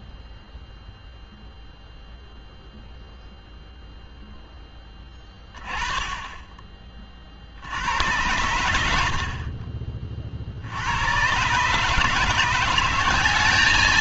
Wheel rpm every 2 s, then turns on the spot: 0, 0, 0, 20, 100, 70, 170.
none